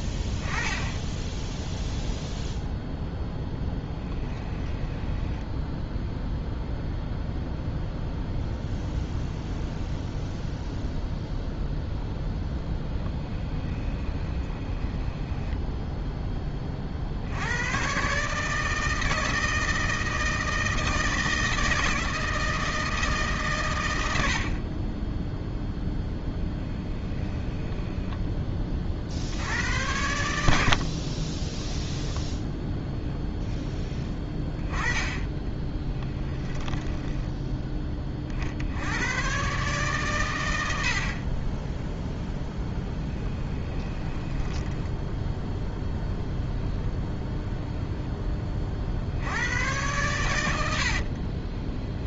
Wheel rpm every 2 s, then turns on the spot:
10, 0, 10, 0, 0, 0, 10, 20, 30, 160, 160, 160, 50, 10, 20, 70, 0, 10, 10, 70, 100, 10, 10, 0, 30, 80.
4-6 12-16 36-38 44-46